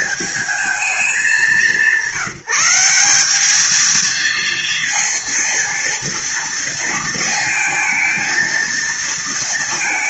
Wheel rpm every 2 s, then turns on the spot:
200, 180, 230, 230, 220.
none